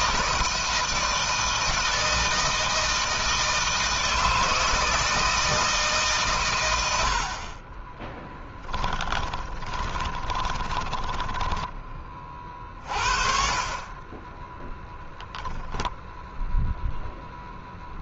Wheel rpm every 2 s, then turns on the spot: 160, 160, 160, 100, 10, 10, 30, 10, 0.
8-12